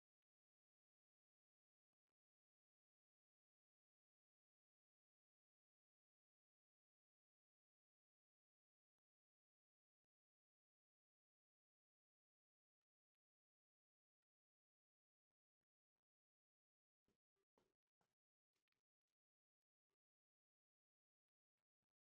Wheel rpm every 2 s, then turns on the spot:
0, 0, 0, 0, 0, 0, 0, 0, 0, 0, 0.
none